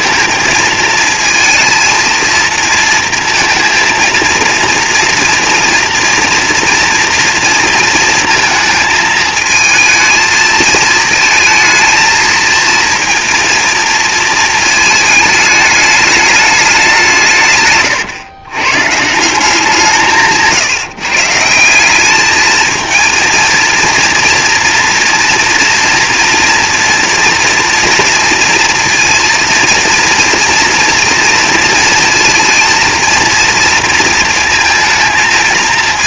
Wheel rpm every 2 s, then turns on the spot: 230, 230, 230, 230, 230, 220, 220, 220, 200, 130, 160, 220, 240, 230, 230, 240, 230, 230.
none